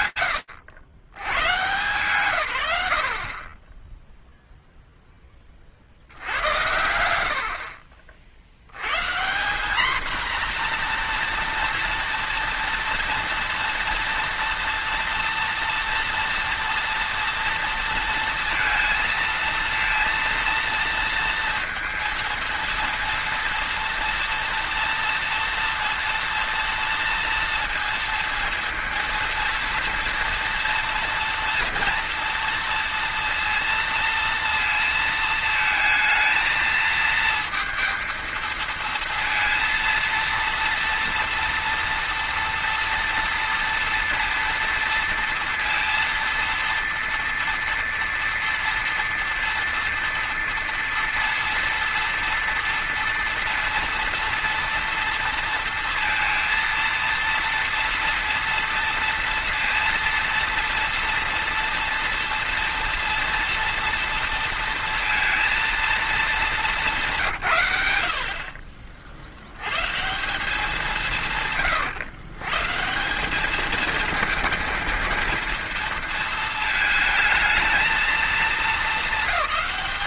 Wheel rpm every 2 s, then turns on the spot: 80, 50, 40, 70, 190, 240, 230, 230, 230, 230, 230, 230, 230, 230, 230, 230, 230, 220, 230, 230, 230, 230, 230, 230, 230, 230, 230, 230, 230, 230, 230, 230, 230, 120, 70, 150, 190, 230, 220, 220.
none